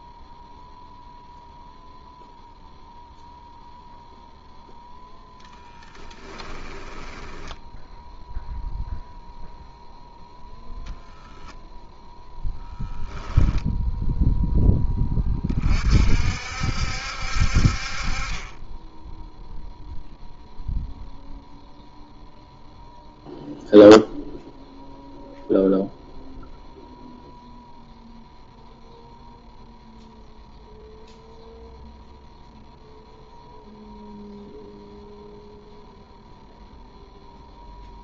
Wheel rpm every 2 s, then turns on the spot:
0, 0, 0, 10, 0, 0, 0, 10, 60, 10, 0, 0, 0, 0, 0, 0, 0, 0, 0.
6-8